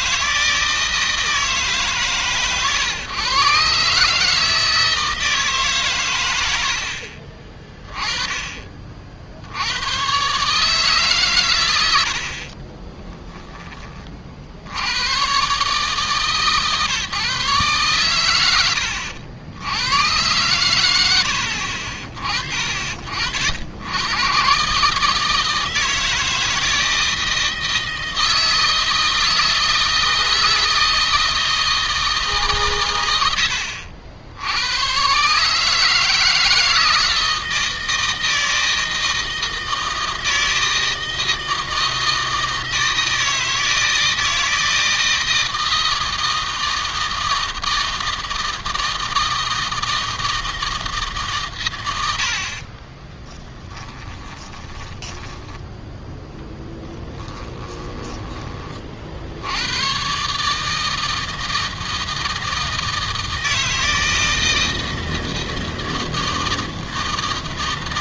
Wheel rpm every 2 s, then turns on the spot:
160, 130, 160, 70, 40, 140, 30, 90, 140, 100, 100, 50, 140, 160, 160, 160, 120, 110, 160, 160, 160, 160, 160, 160, 160, 160, 40, 20, 10, 40, 160, 160, 160, 160.
12-14 52-58